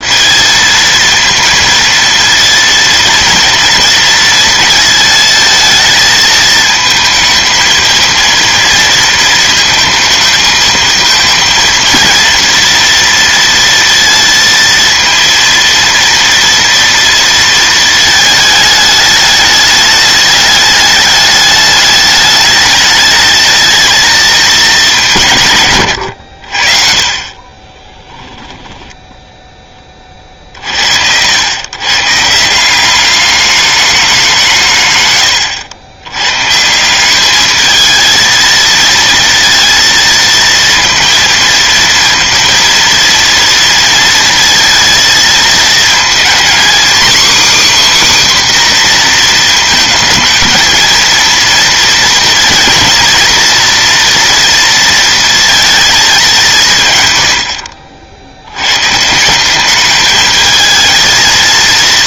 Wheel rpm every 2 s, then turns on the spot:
230, 230, 220, 220, 230, 220, 230, 230, 230, 210, 210, 220, 200, 60, 10, 60, 190, 140, 160, 220, 230, 230, 220, 250, 250, 220, 240, 230, 150, 130, 220.
28-30